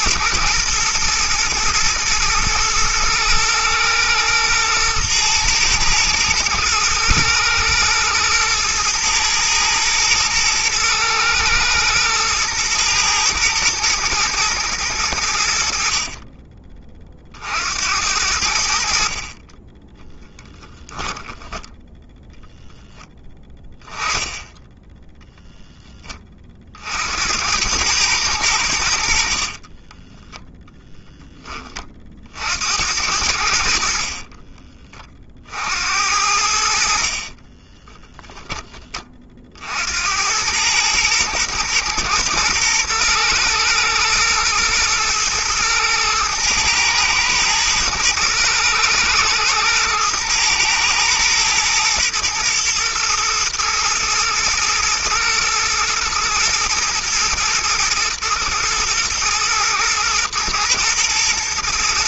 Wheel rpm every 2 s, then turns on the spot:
110, 120, 110, 120, 110, 110, 110, 100, 20, 70, 10, 10, 10, 60, 80, 0, 70, 30, 60, 20, 110, 110, 120, 110, 110, 110, 120, 120, 120, 110, 110.
20-22 24-26